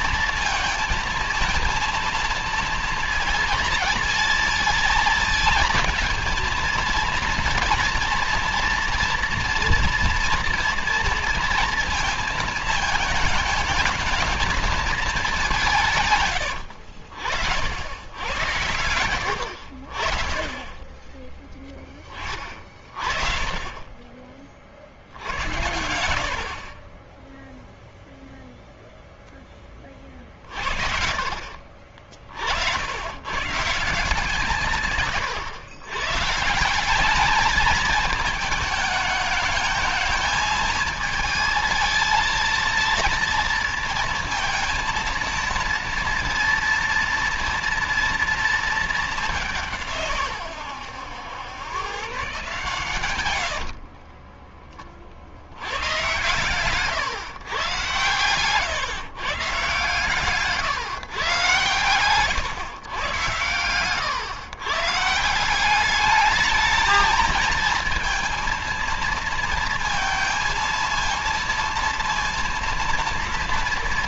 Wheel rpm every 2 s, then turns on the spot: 220, 230, 230, 230, 240, 230, 220, 210, 70, 80, 20, 40, 70, 20, 0, 60, 110, 130, 210, 220, 220, 230, 230, 230, 200, 100, 110, 50, 130, 140, 140, 100, 150, 220, 230, 230, 230.
52-54